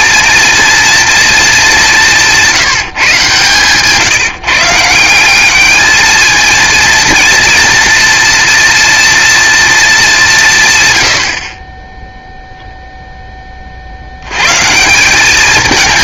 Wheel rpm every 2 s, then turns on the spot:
230, 160, 170, 230, 230, 100, 0, 170.
none